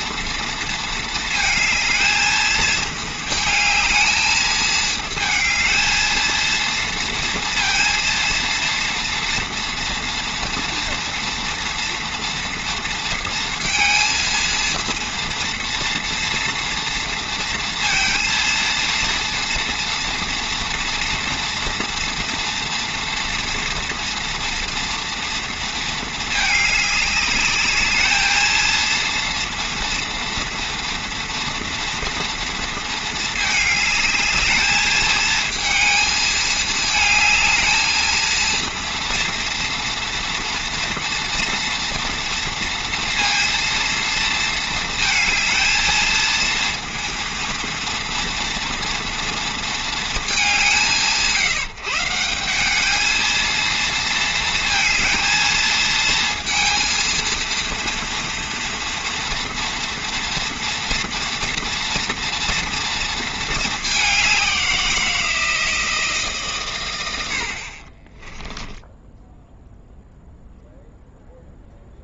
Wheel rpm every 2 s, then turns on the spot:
230, 220, 220, 230, 230, 230, 230, 230, 230, 230, 230, 230, 230, 210, 220, 240, 230, 220, 220, 230, 230, 230, 230, 230, 230, 170, 200, 230, 220, 230, 240, 230, 180, 130, 0, 0.
none